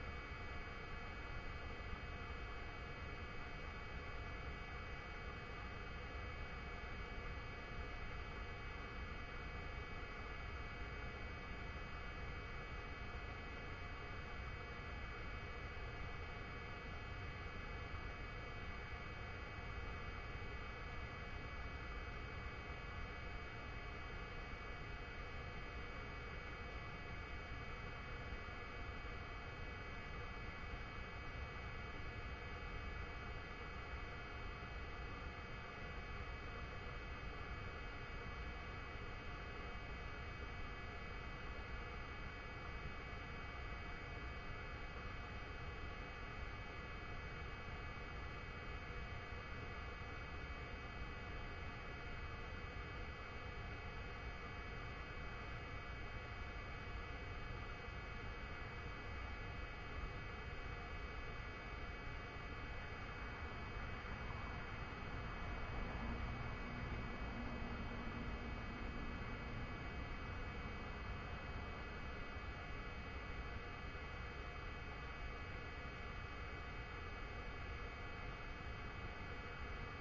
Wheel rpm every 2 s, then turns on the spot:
0, 0, 0, 0, 0, 0, 0, 0, 0, 0, 0, 0, 0, 0, 0, 0, 0, 0, 0, 0, 0, 0, 0, 0, 0, 0, 0, 0, 0, 0, 0, 0, 0, 0, 0, 0, 0, 0, 0, 0.
none